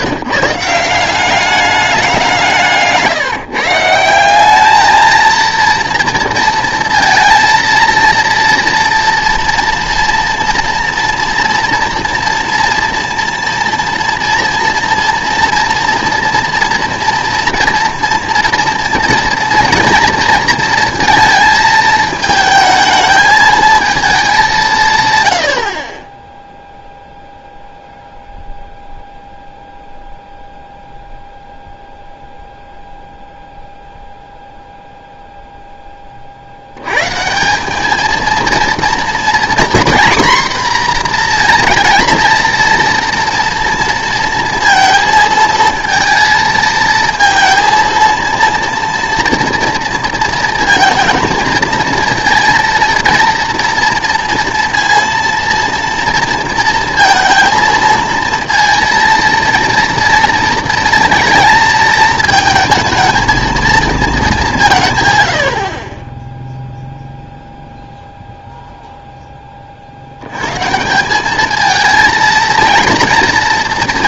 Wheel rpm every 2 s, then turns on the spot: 150, 160, 200, 230, 230, 230, 230, 230, 240, 230, 230, 220, 170, 0, 0, 0, 0, 0, 70, 230, 250, 230, 230, 220, 230, 230, 230, 230, 230, 230, 230, 220, 180, 0, 0, 130, 230.
none